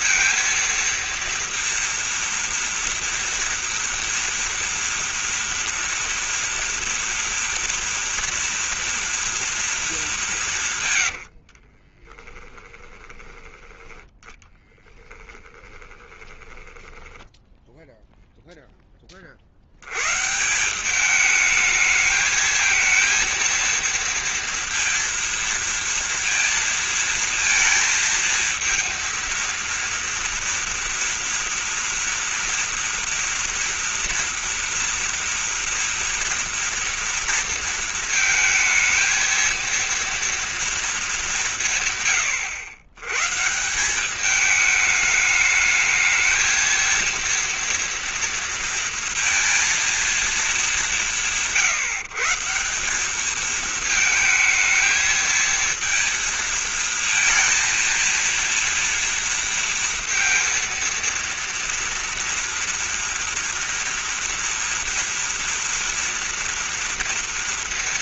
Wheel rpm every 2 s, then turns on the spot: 230, 230, 230, 230, 230, 180, 20, 10, 10, 0, 160, 220, 230, 230, 230, 230, 240, 230, 230, 230, 230, 100, 210, 220, 230, 210, 160, 220, 230, 230, 230, 230, 230, 230.
12-18